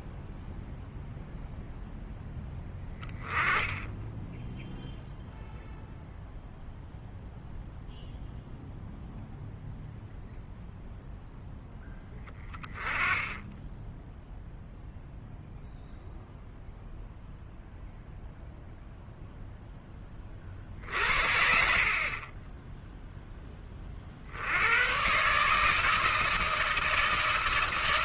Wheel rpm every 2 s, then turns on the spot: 0, 10, 0, 0, 0, 0, 10, 0, 0, 0, 50, 0, 110, 160.
none